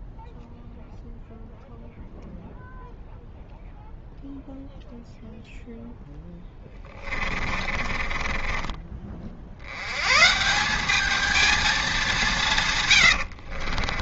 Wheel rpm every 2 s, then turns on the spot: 0, 0, 0, 20, 30, 180, 130.
6-10